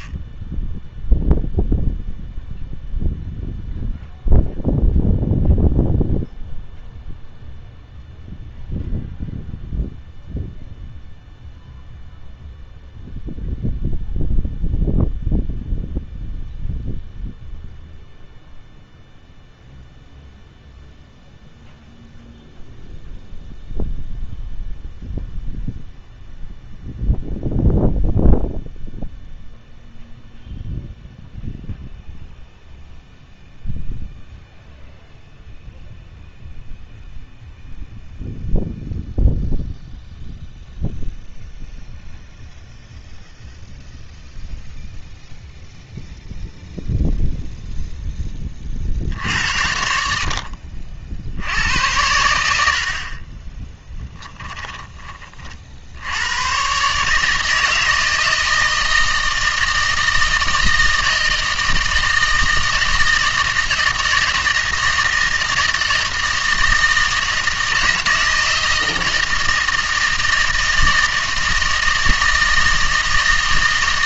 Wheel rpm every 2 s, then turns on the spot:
0, 0, 0, 0, 0, 0, 0, 0, 0, 0, 0, 0, 0, 0, 0, 0, 0, 0, 0, 0, 0, 0, 0, 0, 40, 60, 70, 20, 130, 160, 160, 160, 160, 160, 160, 160, 160.
50-52 54-56